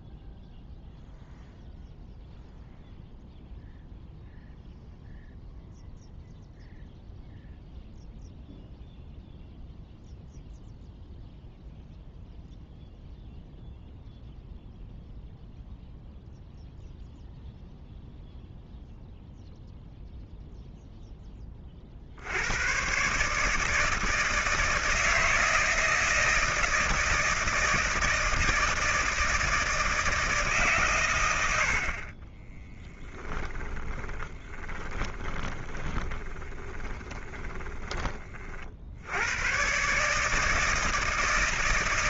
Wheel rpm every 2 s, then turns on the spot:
0, 0, 0, 0, 0, 0, 0, 0, 0, 0, 0, 80, 160, 160, 160, 150, 10, 20, 20, 50, 160.
32-38